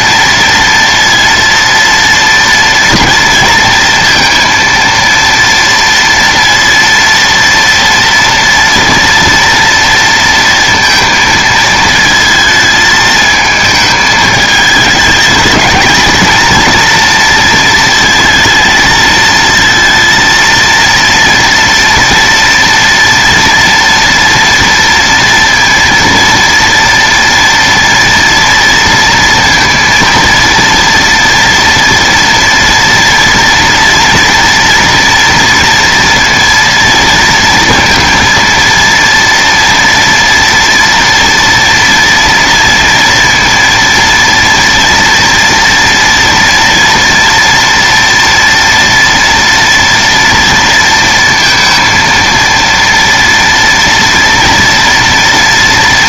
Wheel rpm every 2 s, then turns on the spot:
230, 230, 230, 230, 240, 230, 220, 220, 230, 220, 230, 230, 230, 230, 230, 230, 230, 230, 230, 230, 240, 230, 230, 230, 230, 230, 230, 230.
none